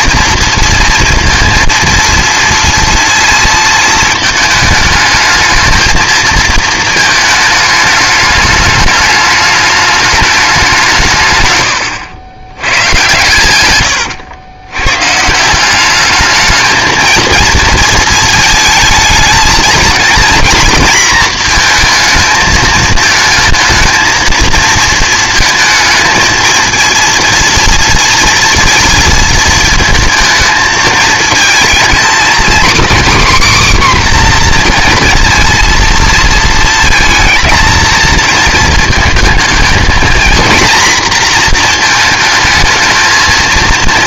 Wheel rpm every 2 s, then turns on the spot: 230, 230, 220, 220, 210, 190, 110, 110, 220, 220, 230, 220, 230, 230, 230, 220, 260, 250, 220, 220, 230, 220.
none